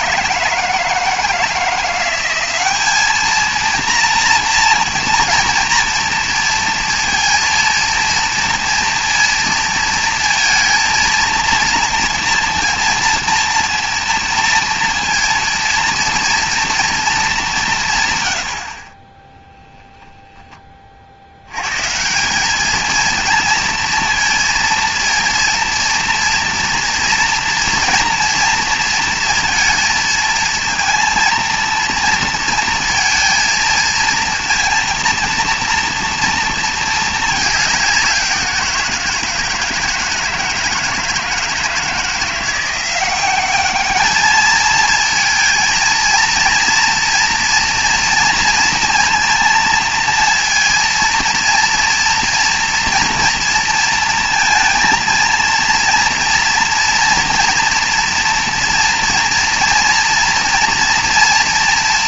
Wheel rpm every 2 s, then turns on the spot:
160, 200, 230, 230, 230, 230, 240, 230, 230, 60, 30, 220, 230, 230, 230, 230, 230, 230, 220, 170, 160, 180, 220, 230, 230, 230, 230, 230, 230, 230, 230.
none